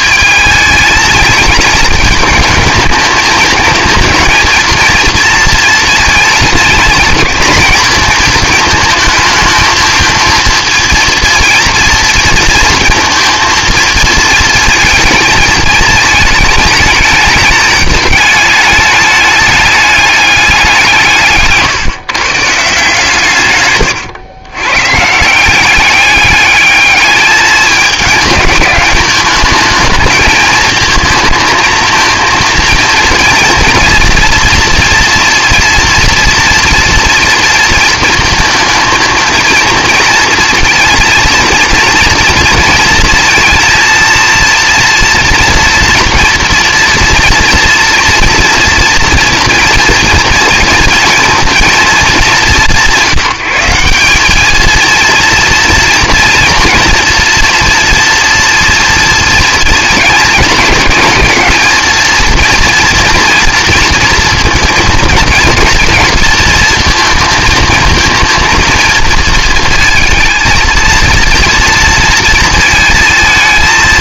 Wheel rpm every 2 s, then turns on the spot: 220, 220, 230, 230, 220, 220, 230, 230, 220, 210, 190, 150, 120, 210, 210, 220, 230, 230, 230, 220, 230, 230, 230, 230, 230, 230, 180, 230, 240, 230, 210, 230, 230, 220, 230, 230, 230.
none